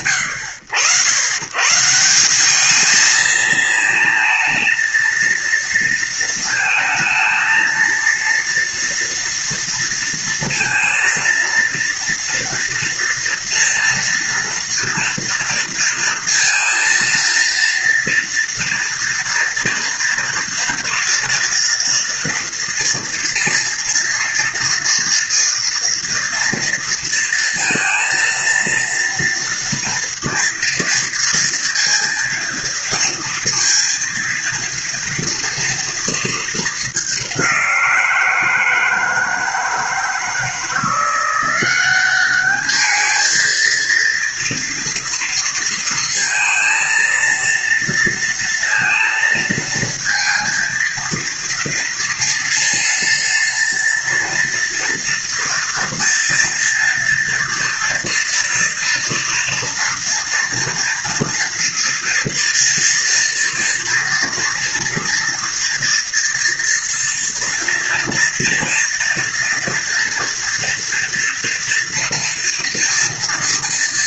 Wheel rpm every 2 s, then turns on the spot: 100, 210, 230, 220, 230, 230, 230, 230, 230, 230, 230, 230, 230, 230, 230, 230, 230, 230, 210, 160, 170, 210, 230, 230, 230, 230, 230, 230, 230, 230, 240, 230, 230, 240, 230, 230, 230.
none